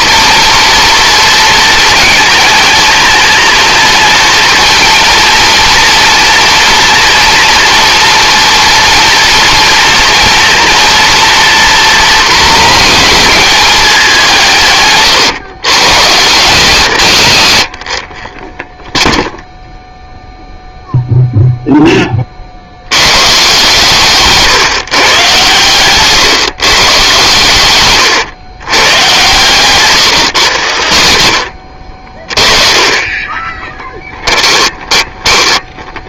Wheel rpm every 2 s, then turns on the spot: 230, 220, 230, 230, 230, 230, 240, 150, 130, 0, 0, 80, 150, 130, 120, 110, 30, 10.
32-36